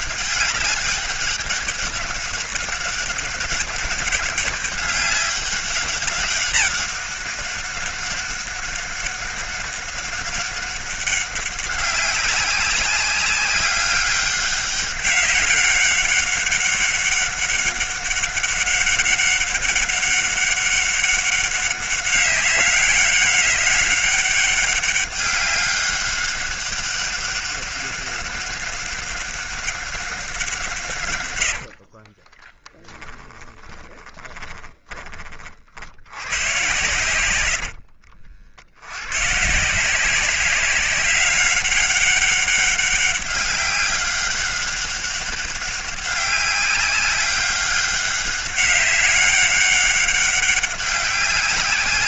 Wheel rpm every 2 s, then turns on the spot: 200, 200, 200, 200, 200, 200, 200, 190, 200, 200, 190, 200, 200, 200, 200, 150, 10, 20, 110, 70, 190, 200, 200, 200, 200, 200.
32-36